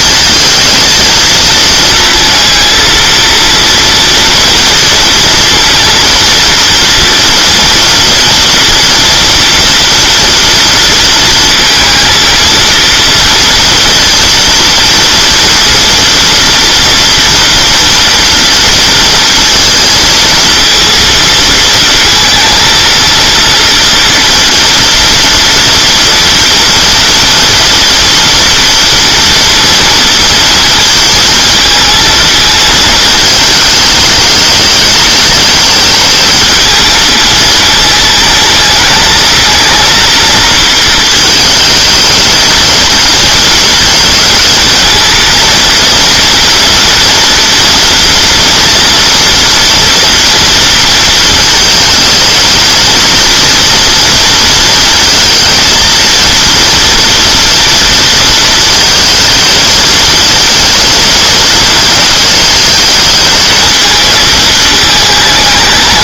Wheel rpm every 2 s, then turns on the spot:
230, 230, 230, 230, 230, 230, 230, 230, 230, 230, 230, 230, 230, 230, 230, 230, 220, 210, 220, 220, 220, 230, 220, 230, 230, 230, 220, 230, 230, 230, 230, 220, 220.
none